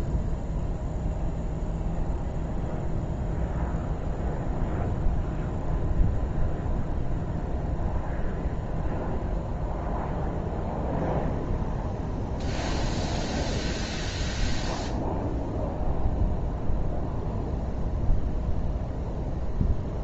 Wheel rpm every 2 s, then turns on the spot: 0, 0, 0, 0, 0, 0, 0, 0, 0, 0.
none